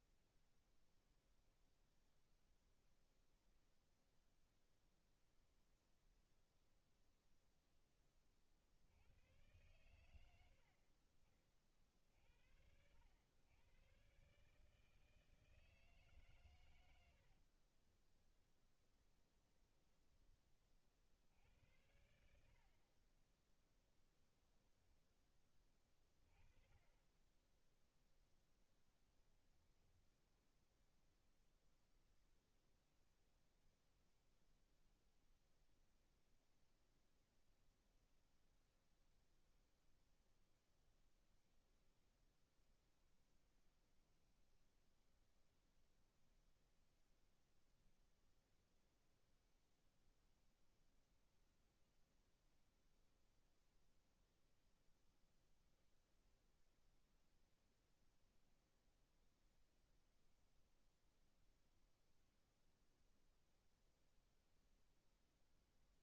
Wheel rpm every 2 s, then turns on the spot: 0, 0, 0, 0, 90, 50, 90, 160, 70, 10, 60, 30, 10, 20, 10, 0, 0, 0, 0, 0, 0, 0, 0, 0, 0, 0, 0, 0, 0, 0, 0, 0, 0.
16-20 28-30